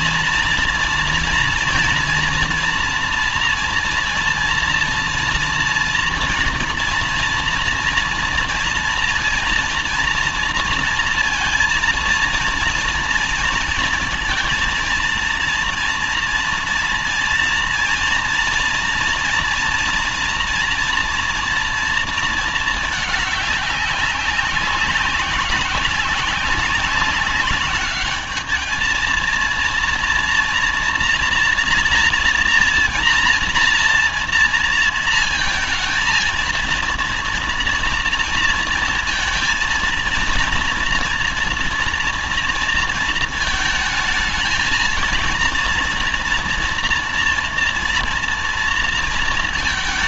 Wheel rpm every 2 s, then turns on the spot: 230, 230, 230, 230, 230, 230, 230, 230, 230, 230, 240, 220, 190, 200, 220, 230, 240, 230, 230, 230, 230, 230, 220, 230, 230.
none